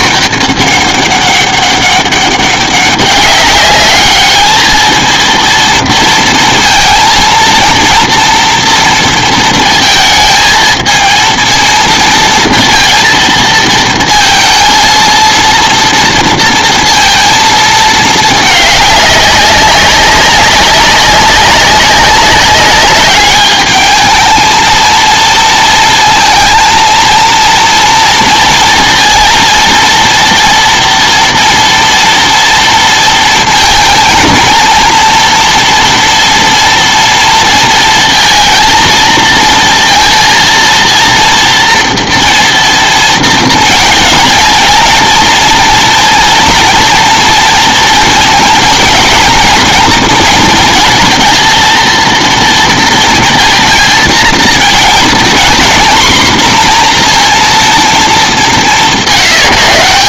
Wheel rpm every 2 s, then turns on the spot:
200, 190, 210, 230, 230, 220, 230, 230, 230, 210, 200, 200, 220, 230, 230, 230, 230, 230, 230, 230, 230, 230, 230, 240, 220, 230, 230, 240, 240, 200.
none